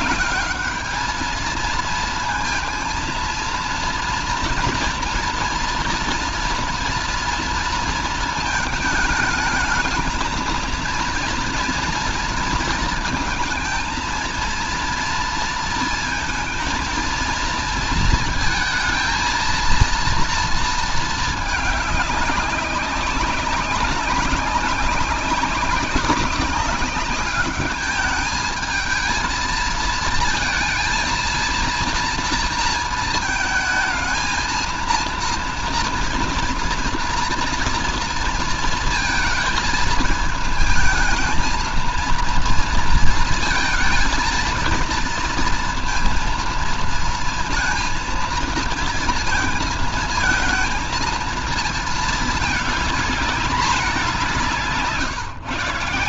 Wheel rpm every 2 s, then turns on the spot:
210, 230, 230, 230, 220, 230, 230, 230, 230, 230, 230, 200, 190, 190, 220, 230, 230, 230, 230, 230, 220, 230, 230, 230, 230, 220, 220, 170.
none